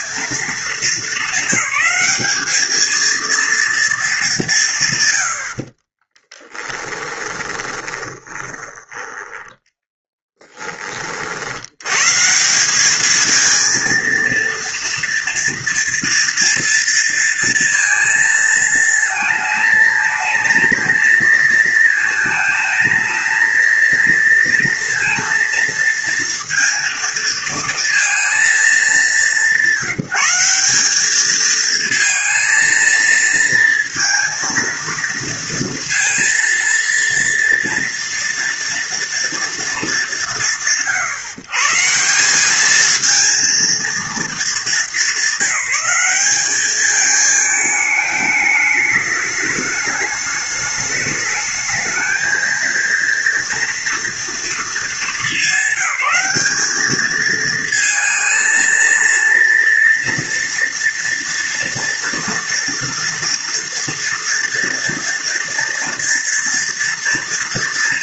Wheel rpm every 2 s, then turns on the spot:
230, 220, 190, 20, 20, 10, 160, 230, 230, 230, 230, 230, 230, 230, 230, 180, 230, 230, 230, 230, 150, 190, 220, 200, 210, 210, 220, 230, 210, 230, 230, 240, 230, 230.
6-10